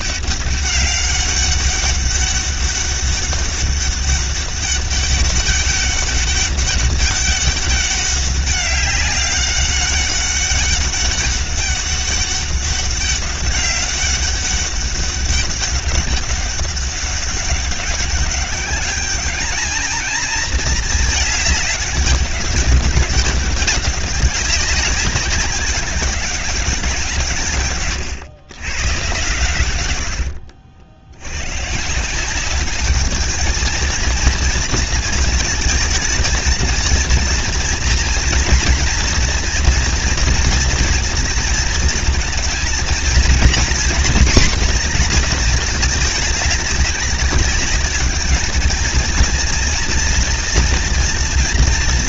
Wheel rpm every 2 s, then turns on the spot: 190, 200, 200, 200, 200, 200, 200, 200, 200, 200, 220, 200, 200, 200, 120, 70, 200, 230, 220, 230, 230, 220, 250, 210, 220, 230.
none